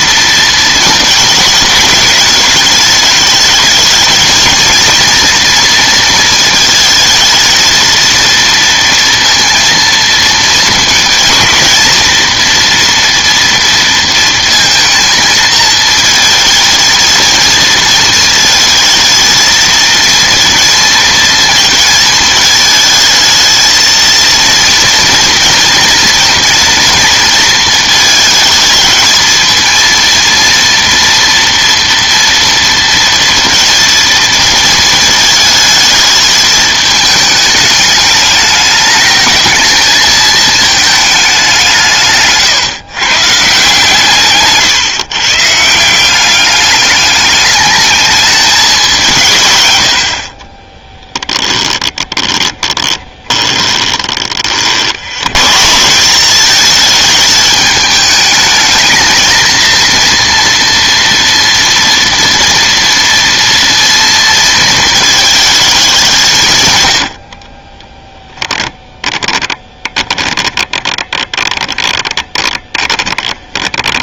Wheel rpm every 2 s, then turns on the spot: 230, 210, 230, 220, 230, 220, 230, 230, 220, 220, 230, 220, 230, 230, 220, 230, 230, 220, 220, 210, 220, 150, 130, 200, 210, 40, 20, 60, 210, 220, 230, 230, 220, 130, 10, 20, 30.
50-54 68-74